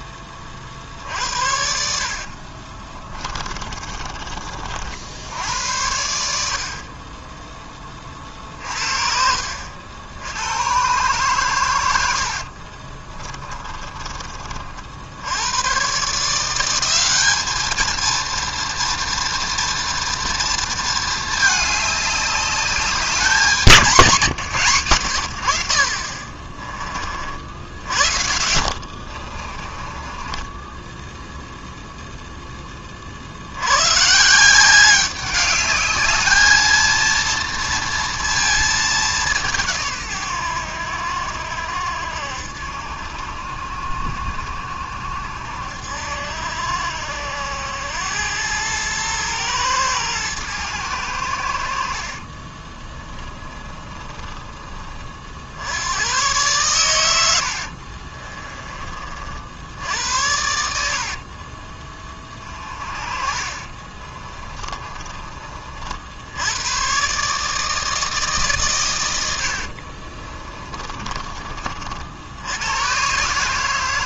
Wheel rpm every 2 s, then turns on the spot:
50, 20, 60, 30, 50, 120, 30, 60, 190, 230, 220, 200, 120, 40, 70, 10, 40, 190, 230, 210, 80, 70, 70, 70, 110, 100, 20, 40, 110, 40, 70, 40, 20, 120, 100, 20, 120.
2-4 12-14 28-32 52-54 62-66 70-72